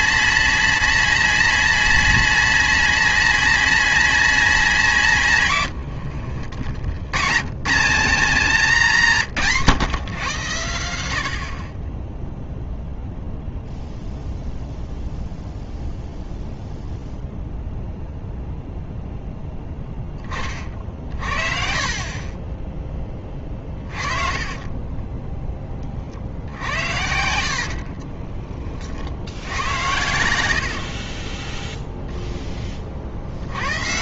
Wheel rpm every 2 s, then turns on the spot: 120, 10, 240, 240, 120, 170, 10, 0, 0, 0, 40, 20, 10, 70, 60, 20, 70.
30-32